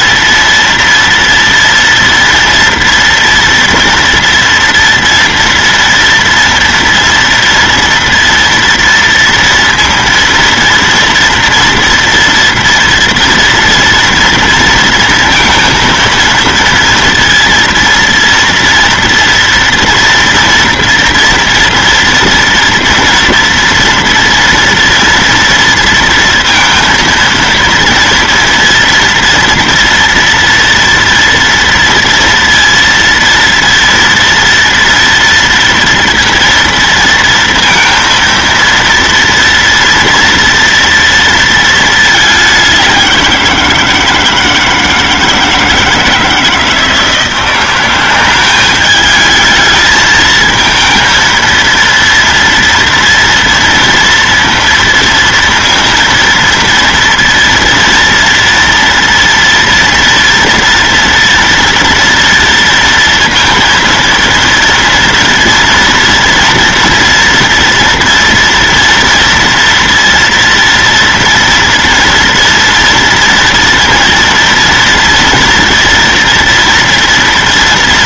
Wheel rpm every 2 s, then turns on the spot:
230, 240, 230, 240, 230, 230, 230, 230, 230, 230, 230, 230, 240, 230, 230, 230, 230, 240, 230, 230, 230, 190, 160, 160, 200, 230, 230, 230, 230, 230, 230, 230, 230, 230, 230, 230, 230, 230, 230.
none